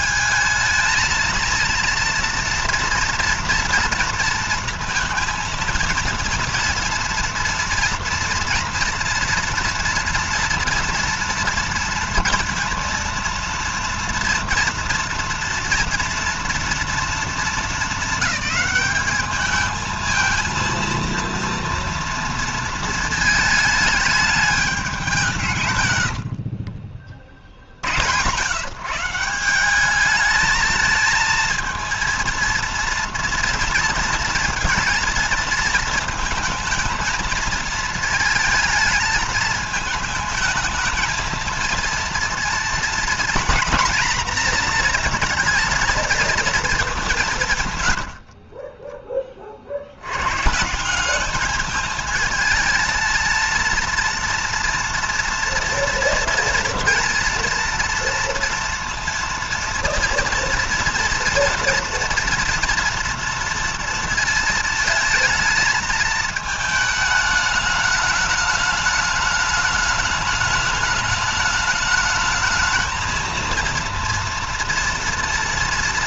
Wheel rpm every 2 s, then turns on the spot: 220, 230, 230, 230, 230, 240, 230, 230, 230, 210, 230, 230, 200, 50, 150, 220, 230, 230, 220, 220, 220, 230, 230, 210, 40, 160, 220, 230, 230, 230, 230, 230, 220, 220, 210, 210, 220, 230.
26-28 48-50